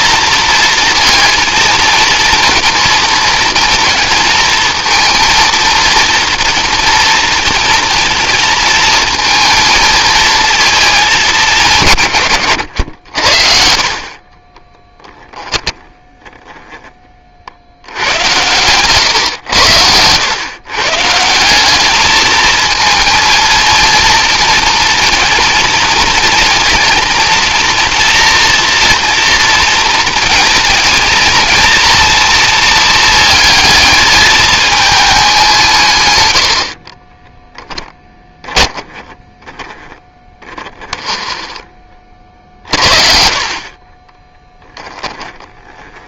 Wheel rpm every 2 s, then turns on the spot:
230, 230, 220, 230, 220, 220, 100, 10, 10, 110, 140, 220, 230, 220, 230, 230, 230, 220, 50, 10, 20, 40, 10.
12-16 36-42 44-46